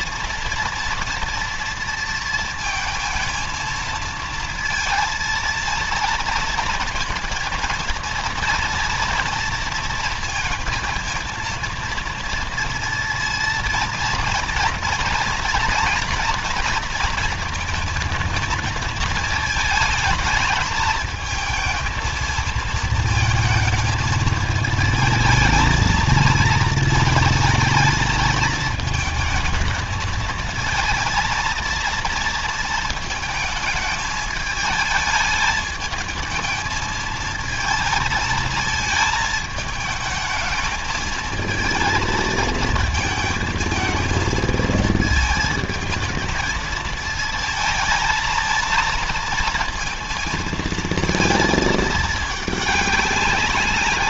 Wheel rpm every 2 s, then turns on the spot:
230, 230, 230, 230, 230, 220, 230, 230, 230, 220, 220, 220, 220, 220, 220, 220, 230, 210, 220, 220, 220, 220, 220, 220, 220, 220, 210.
none